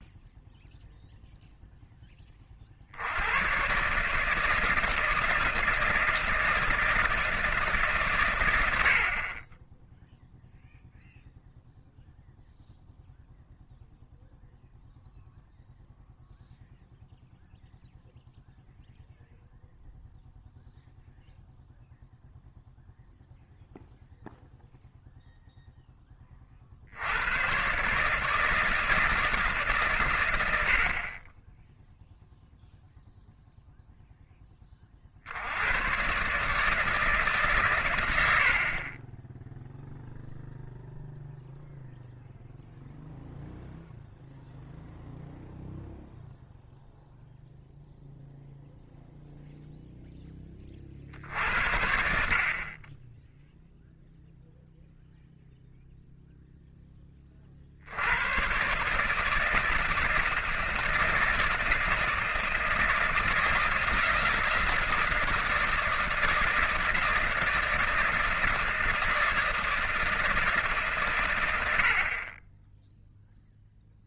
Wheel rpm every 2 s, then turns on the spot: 0, 40, 160, 160, 90, 0, 0, 0, 0, 0, 0, 0, 0, 50, 160, 70, 0, 20, 150, 50, 0, 0, 0, 0, 0, 30, 30, 0, 0, 130, 160, 160, 160, 160, 160, 150, 20.
none